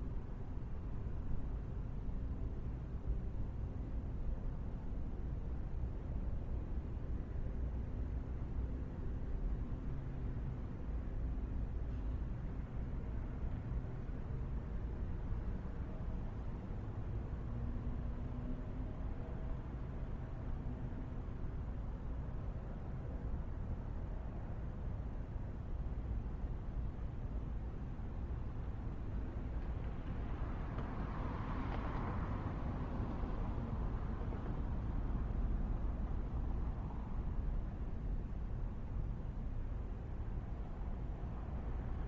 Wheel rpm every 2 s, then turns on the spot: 0, 0, 0, 0, 0, 0, 0, 0, 0, 0, 0, 0, 0, 0, 0, 0, 0, 0, 0, 0, 0.
none